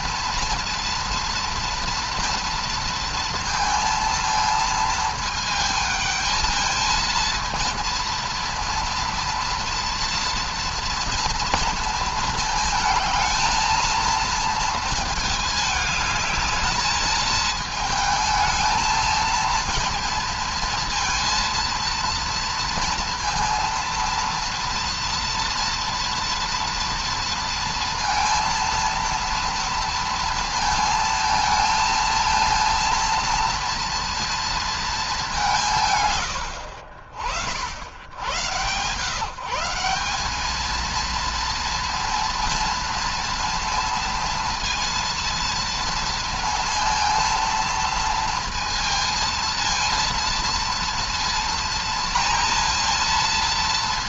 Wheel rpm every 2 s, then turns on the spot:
240, 230, 220, 220, 230, 230, 220, 230, 210, 220, 230, 230, 230, 230, 230, 230, 230, 230, 80, 130, 220, 230, 230, 230, 230, 230, 230.
none